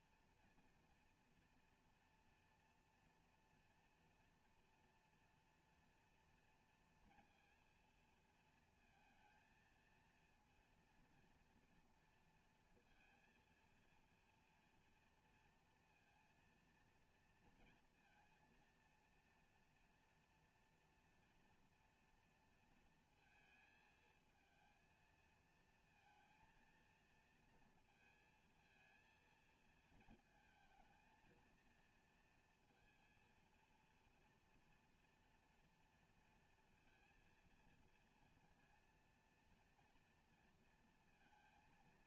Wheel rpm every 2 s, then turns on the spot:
240, 230, 240, 240, 230, 230, 230, 230, 230, 230, 230, 230, 220, 230, 230, 230, 230, 230, 230, 230, 240.
none